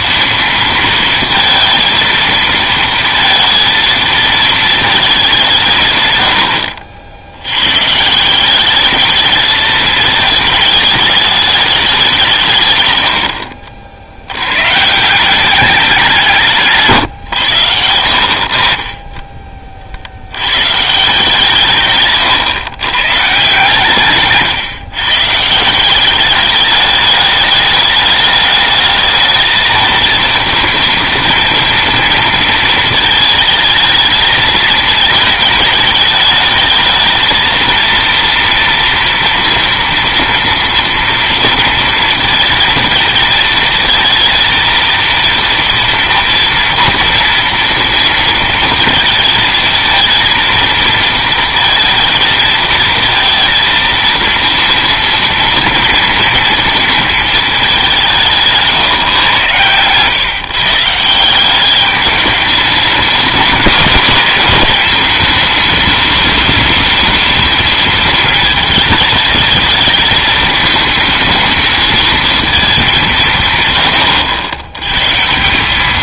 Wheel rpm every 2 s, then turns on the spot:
230, 230, 220, 80, 190, 220, 140, 120, 160, 50, 120, 130, 130, 200, 210, 220, 230, 220, 220, 230, 230, 230, 220, 230, 220, 230, 230, 230, 230, 160, 140, 210, 220, 210, 220, 220, 220, 100.
none